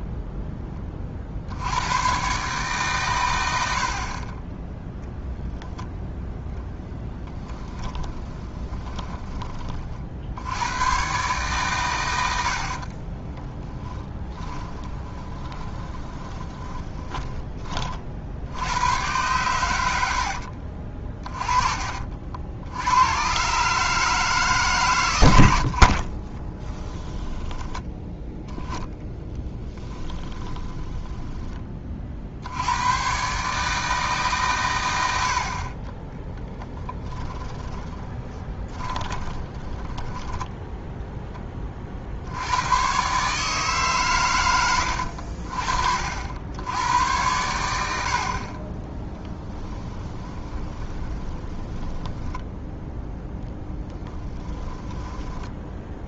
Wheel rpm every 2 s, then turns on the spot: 20, 130, 10, 10, 20, 110, 40, 20, 20, 100, 50, 90, 130, 20, 10, 10, 100, 100, 10, 20, 0, 110, 90, 90, 30, 20, 10, 10.
6-10 12-18 26-28 30-32 36-40 50-52 54-56